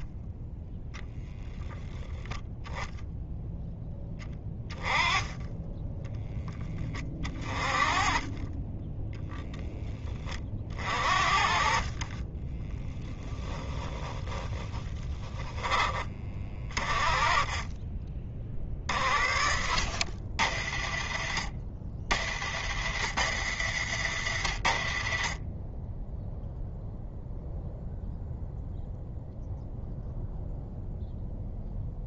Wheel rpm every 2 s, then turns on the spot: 0, 0, 20, 20, 10, 50, 10, 10, 30, 40, 50, 70, 40, 0, 0, 0.
12-16